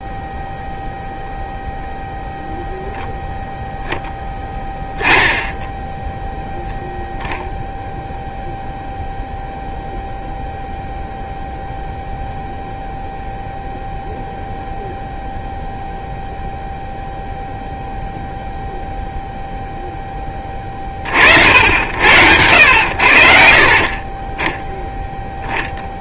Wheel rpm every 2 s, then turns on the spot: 0, 0, 10, 0, 0, 0, 0, 0, 0, 0, 30, 80, 10.
none